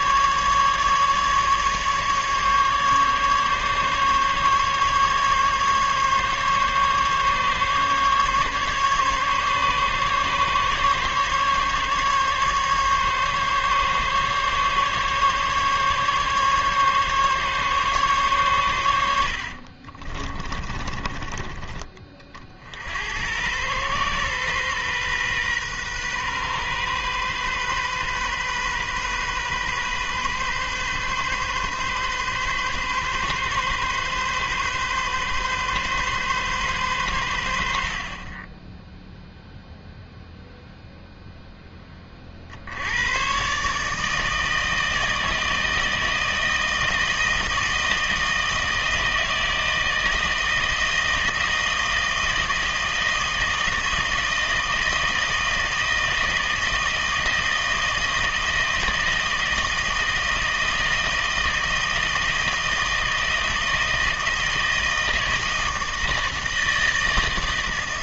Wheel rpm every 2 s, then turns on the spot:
150, 150, 140, 140, 140, 140, 140, 140, 140, 100, 30, 80, 130, 130, 130, 130, 130, 130, 120, 10, 0, 80, 160, 160, 160, 160, 160, 160, 160, 160, 160, 160, 160, 160.
20-22